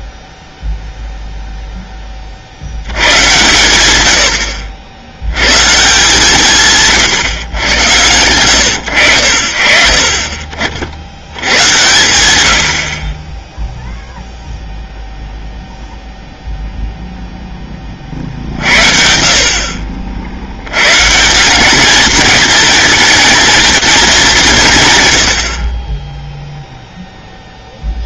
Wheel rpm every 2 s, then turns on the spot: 0, 100, 70, 140, 90, 60, 50, 0, 0, 50, 110, 230, 190, 0.
none